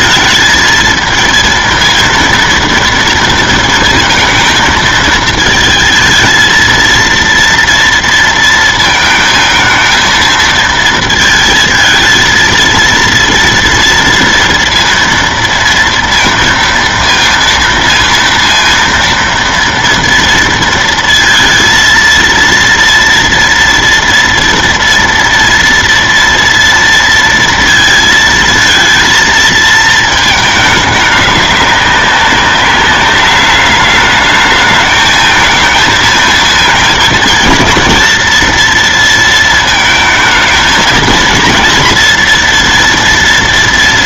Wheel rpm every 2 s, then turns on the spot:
220, 230, 220, 230, 230, 230, 230, 230, 230, 230, 230, 230, 240, 230, 230, 210, 200, 210, 220, 230, 220, 230.
none